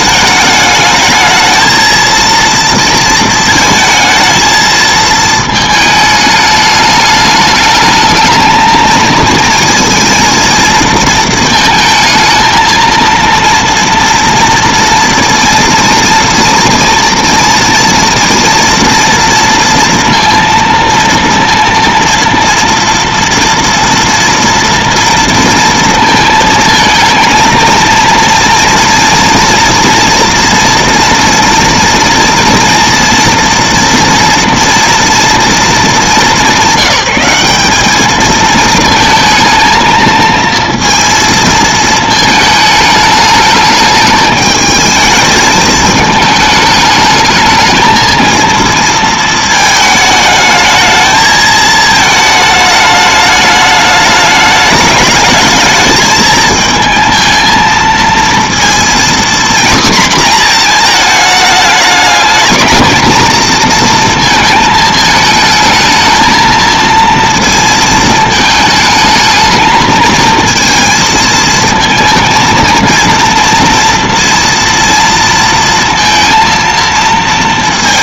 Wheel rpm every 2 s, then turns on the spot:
210, 230, 220, 210, 220, 230, 230, 230, 230, 230, 230, 230, 230, 220, 230, 230, 240, 240, 180, 230, 230, 220, 220, 210, 230, 220, 220, 210, 220, 240, 220, 220, 220, 230, 220, 230, 230, 230, 230.
none